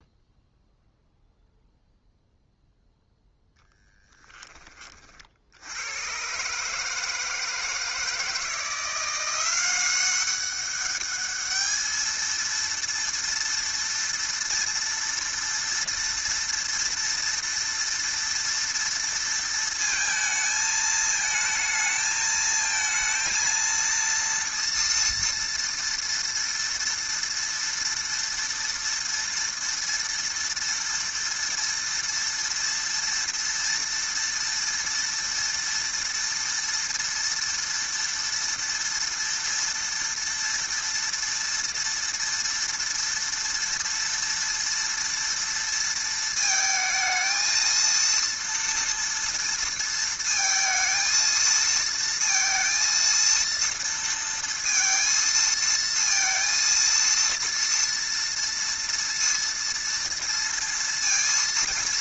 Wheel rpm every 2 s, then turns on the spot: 0, 0, 20, 140, 170, 200, 230, 230, 230, 230, 220, 220, 230, 230, 230, 230, 230, 230, 230, 230, 230, 230, 230, 220, 230, 230, 230, 230, 230, 230, 230.
none